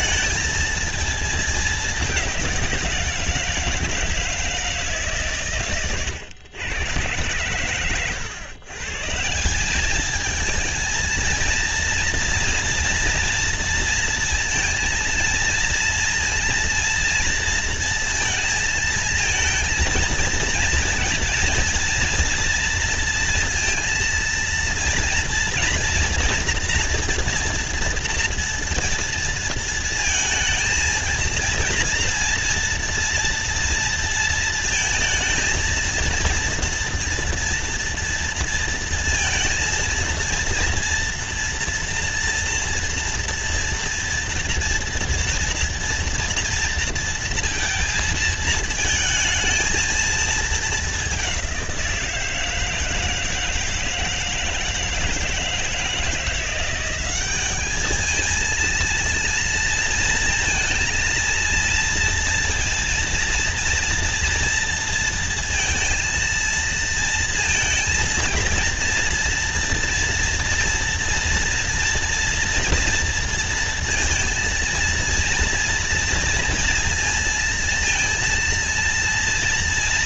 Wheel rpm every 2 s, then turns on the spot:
230, 190, 160, 120, 130, 220, 230, 230, 230, 230, 230, 230, 230, 230, 240, 230, 230, 230, 230, 230, 230, 230, 230, 230, 220, 210, 170, 160, 170, 230, 230, 230, 230, 230, 230, 230, 230, 230, 230, 230.
none